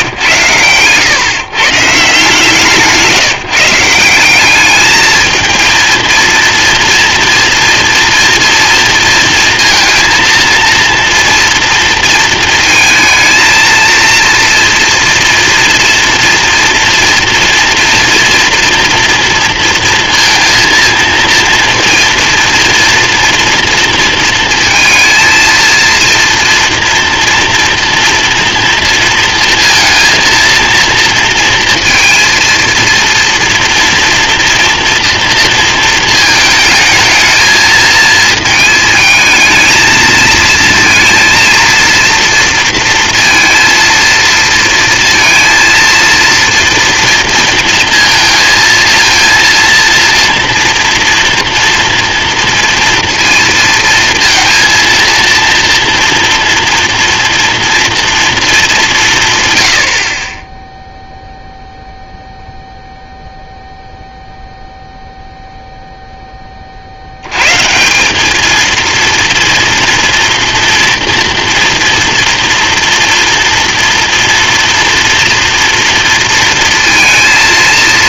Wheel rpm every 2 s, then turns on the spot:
120, 160, 190, 230, 230, 230, 230, 230, 230, 240, 230, 240, 230, 230, 230, 230, 230, 230, 220, 220, 220, 230, 230, 230, 230, 230, 230, 230, 230, 220, 20, 0, 0, 20, 210, 240, 230, 240, 230.
none